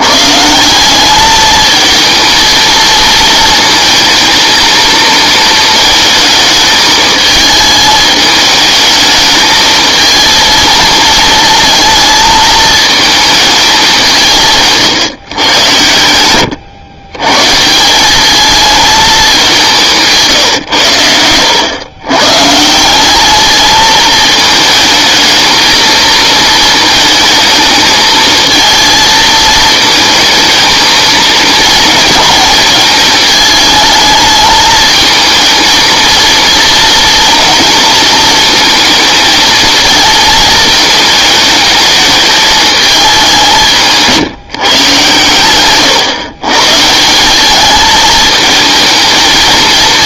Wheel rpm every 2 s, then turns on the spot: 160, 230, 220, 220, 210, 230, 220, 160, 100, 210, 130, 150, 220, 230, 230, 220, 220, 220, 220, 220, 220, 220, 140, 140, 220.
none